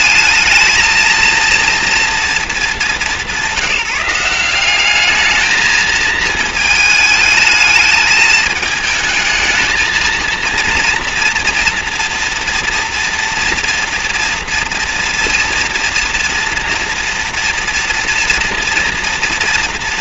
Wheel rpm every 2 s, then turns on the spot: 220, 230, 190, 220, 210, 230, 230, 230, 230, 240.
none